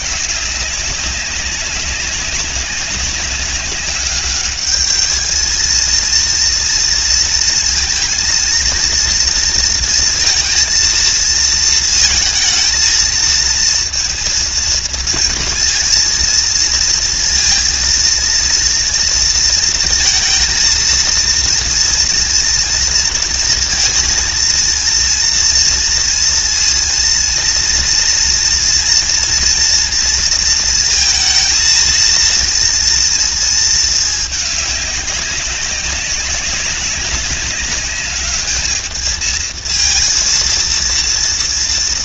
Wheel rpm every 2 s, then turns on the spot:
190, 190, 210, 230, 230, 230, 230, 230, 230, 230, 230, 230, 230, 230, 230, 230, 230, 200, 200, 220, 230.
none